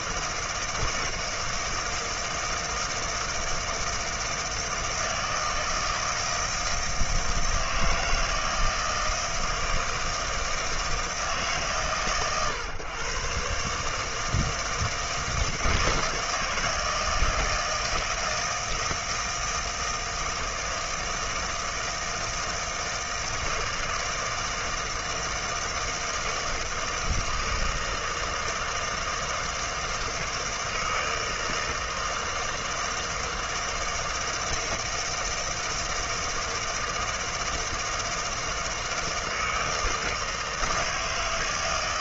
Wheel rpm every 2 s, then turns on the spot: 160, 160, 160, 160, 160, 160, 120, 160, 160, 160, 160, 160, 160, 160, 160, 160, 160, 160, 160, 160, 160.
none